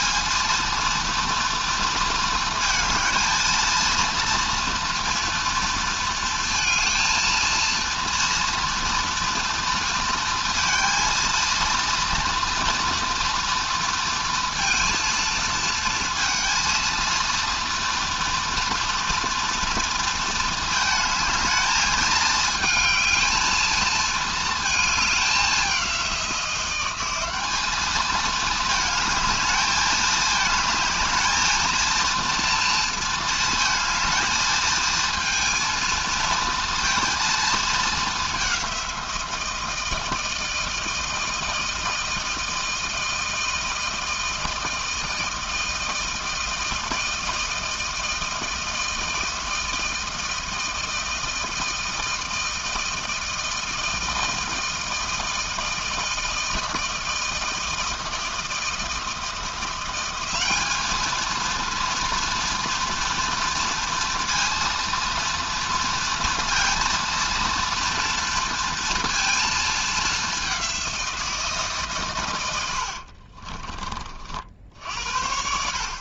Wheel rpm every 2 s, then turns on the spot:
230, 220, 230, 220, 230, 230, 240, 230, 230, 230, 220, 220, 210, 190, 220, 220, 230, 220, 230, 170, 160, 160, 160, 160, 160, 160, 160, 160, 160, 160, 220, 230, 230, 230, 230, 180, 60, 70.
72-74